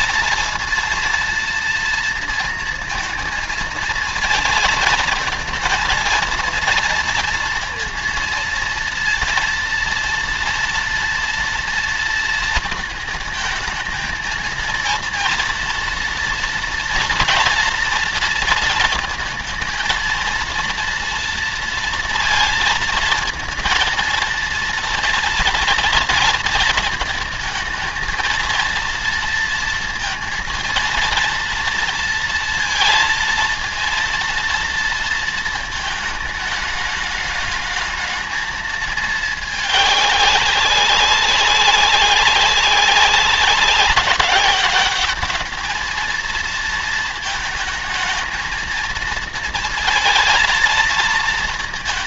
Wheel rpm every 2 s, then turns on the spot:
230, 230, 230, 230, 230, 230, 220, 230, 230, 230, 230, 230, 230, 220, 230, 230, 230, 230, 210, 220, 190, 180, 200, 230, 230, 220.
none